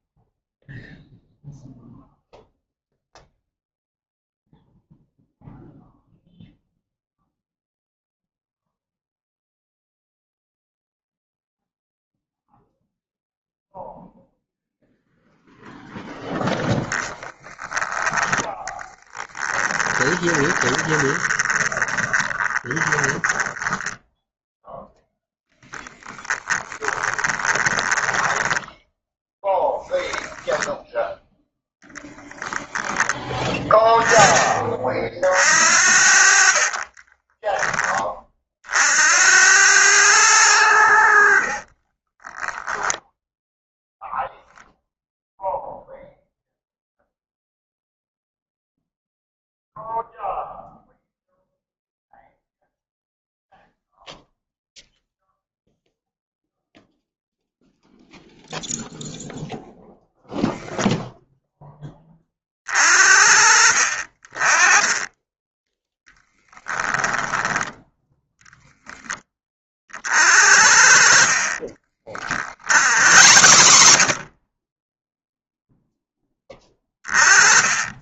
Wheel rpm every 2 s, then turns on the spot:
0, 0, 0, 0, 0, 0, 0, 0, 10, 20, 20, 10, 10, 20, 10, 0, 10, 50, 30, 80, 60, 10, 0, 0, 0, 0, 0, 0, 0, 0, 0, 40, 20, 10, 20, 50, 70, 10, 10.
18-28 34-38 40-44 70-74